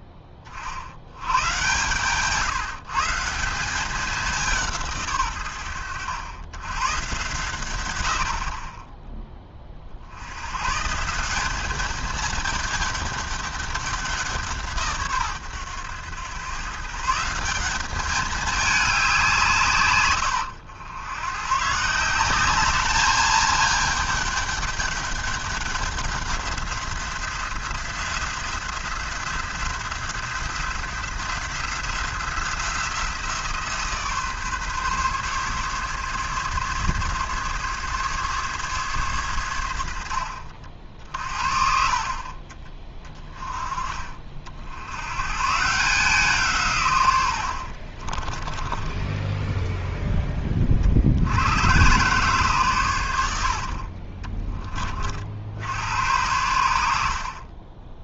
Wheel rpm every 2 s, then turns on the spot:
30, 150, 180, 110, 40, 120, 210, 160, 130, 210, 100, 200, 210, 190, 180, 180, 180, 140, 140, 140, 80, 30, 70, 130, 20, 40, 130, 30, 90.
48-50